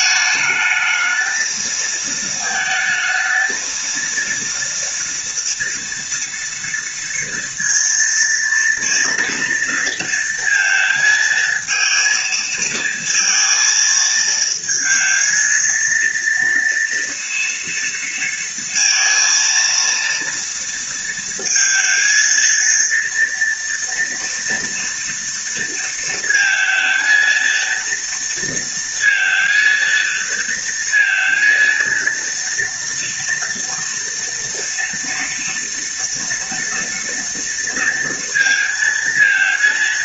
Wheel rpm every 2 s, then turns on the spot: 220, 220, 230, 240, 230, 230, 230, 220, 230, 230, 230, 230, 230, 230, 230, 230, 230, 230, 230, 230.
none